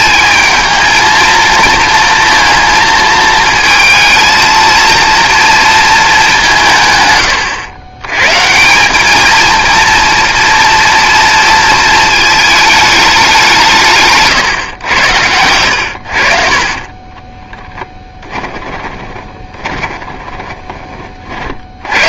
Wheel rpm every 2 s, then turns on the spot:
220, 220, 230, 150, 180, 230, 210, 110, 30, 10, 20.
18-20